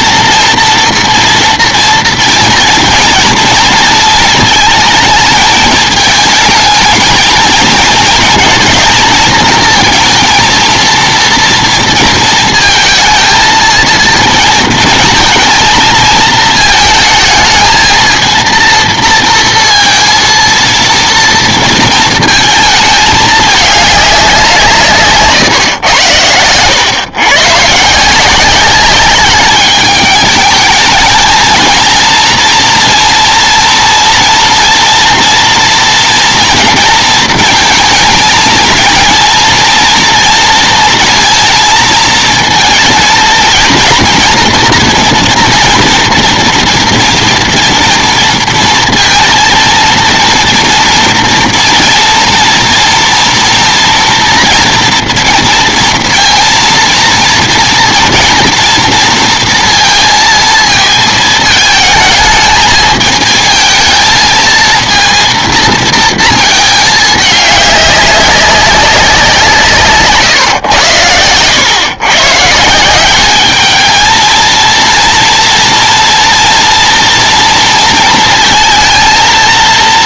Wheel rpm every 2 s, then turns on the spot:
230, 230, 230, 220, 230, 230, 230, 220, 220, 220, 220, 230, 210, 130, 140, 210, 230, 230, 230, 220, 230, 230, 230, 240, 230, 230, 230, 240, 230, 230, 230, 220, 220, 230, 200, 160, 120, 210, 240, 230.
none